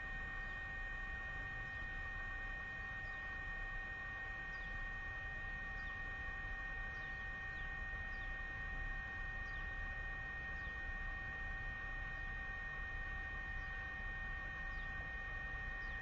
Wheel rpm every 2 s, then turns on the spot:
0, 0, 0, 0, 0, 0, 0, 0.
none